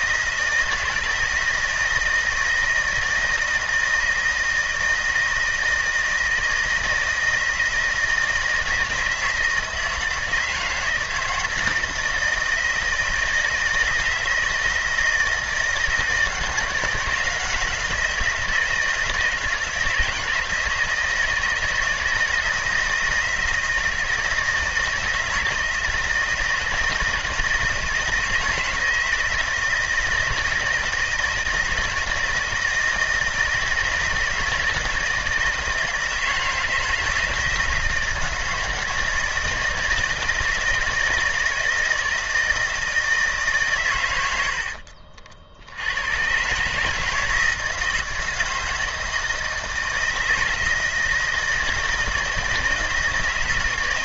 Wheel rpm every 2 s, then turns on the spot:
160, 160, 160, 160, 160, 160, 160, 160, 170, 160, 160, 170, 160, 160, 160, 160, 160, 160, 160, 160, 160, 160, 60, 150, 160, 160, 160.
44-46